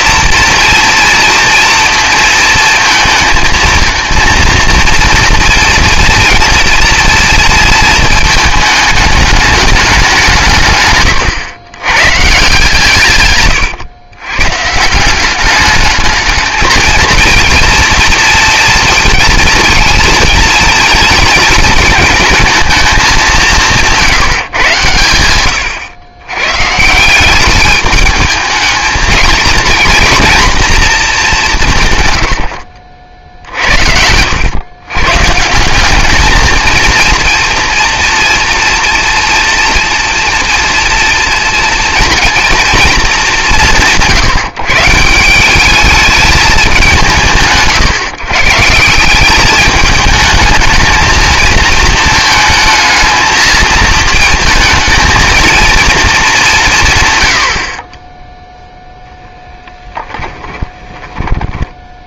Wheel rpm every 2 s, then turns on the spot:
230, 220, 230, 230, 220, 150, 150, 140, 220, 230, 230, 220, 140, 130, 220, 230, 90, 100, 220, 240, 230, 230, 160, 210, 150, 220, 220, 220, 200, 0, 10.
60-62